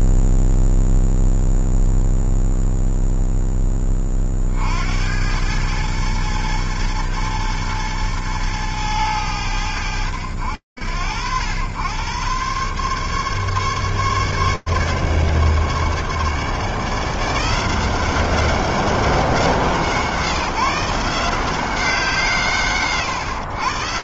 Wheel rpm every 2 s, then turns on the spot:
0, 0, 60, 110, 110, 80, 130, 150, 160, 190, 150, 150.
none